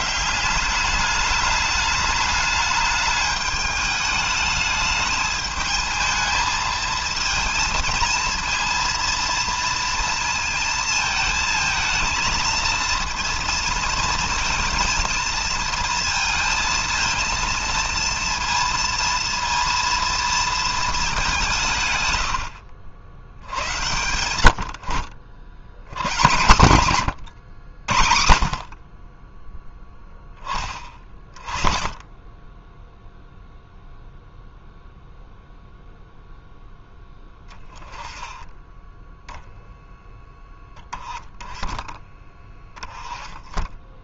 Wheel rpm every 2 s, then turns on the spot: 200, 210, 210, 220, 230, 220, 230, 230, 230, 230, 210, 80, 60, 110, 30, 30, 10, 0, 10, 10, 10, 20.
30-32